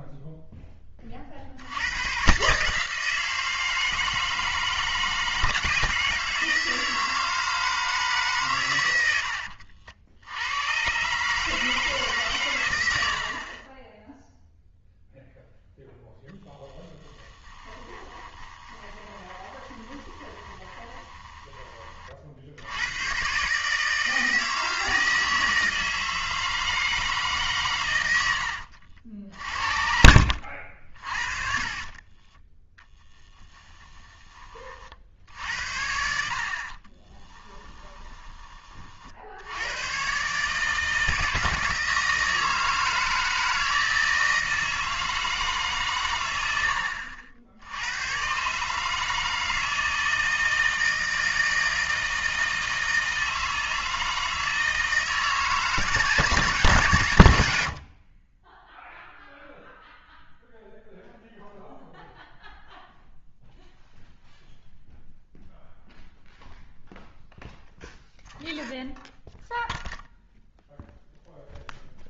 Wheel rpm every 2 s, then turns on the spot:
10, 160, 160, 160, 120, 100, 110, 0, 10, 20, 20, 80, 160, 160, 80, 60, 20, 40, 50, 30, 150, 160, 160, 80, 150, 160, 160, 160, 160, 10, 0, 0, 0, 0, 0, 0.
16-22 28-32 36-38